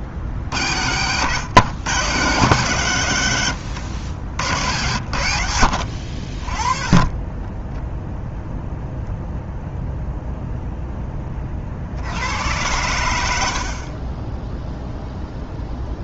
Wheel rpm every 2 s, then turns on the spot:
80, 110, 80, 30, 0, 10, 90, 0.
none